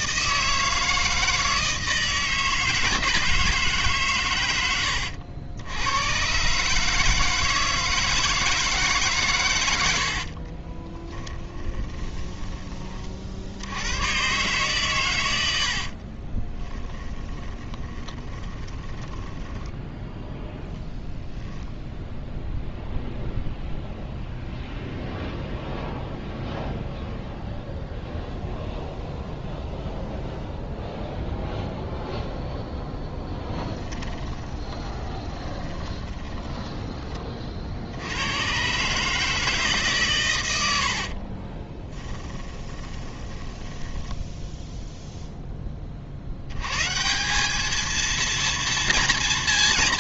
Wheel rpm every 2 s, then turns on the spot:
160, 160, 90, 150, 140, 20, 30, 120, 10, 10, 0, 0, 0, 0, 0, 0, 0, 30, 20, 150, 60, 20, 0, 140, 230.
10-12 16-20 34-36 40-44